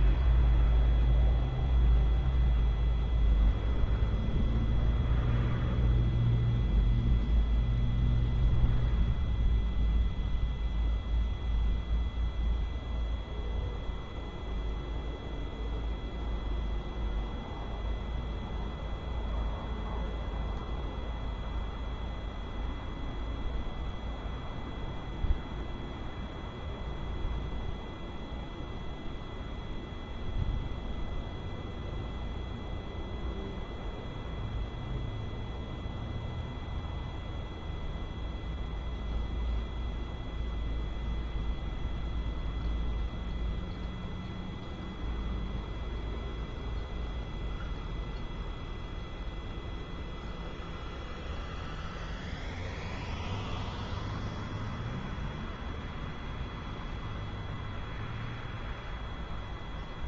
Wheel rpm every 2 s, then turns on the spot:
0, 0, 0, 0, 0, 0, 0, 0, 0, 0, 0, 0, 0, 0, 0, 0, 0, 0, 0, 0, 0, 0, 0, 0, 0, 0, 0, 0, 0, 0.
none